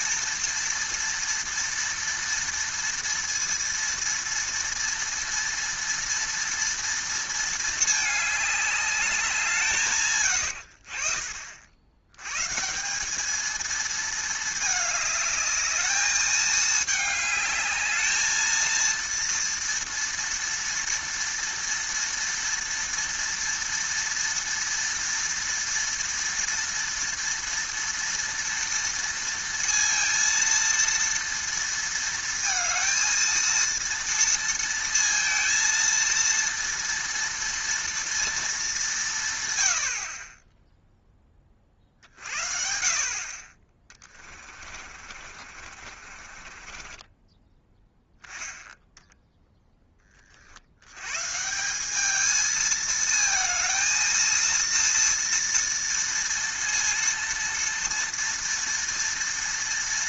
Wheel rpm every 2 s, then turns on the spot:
230, 230, 230, 230, 210, 70, 160, 210, 210, 230, 230, 230, 230, 230, 230, 230, 220, 230, 230, 210, 10, 50, 40, 30, 10, 80, 220, 230, 230, 230.
44-48